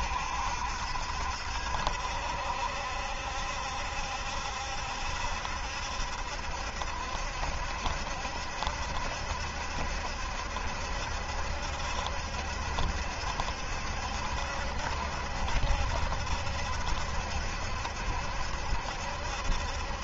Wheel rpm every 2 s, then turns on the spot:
70, 70, 70, 70, 70, 70, 70, 70, 70, 70.
none